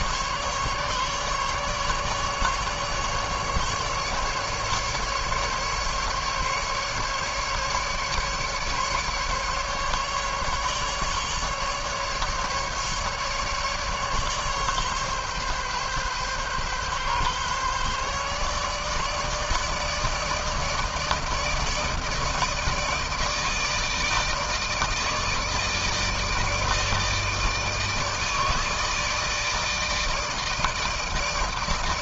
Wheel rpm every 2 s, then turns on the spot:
150, 150, 150, 150, 150, 150, 150, 140, 140, 150, 150, 160, 160, 160, 160, 160.
none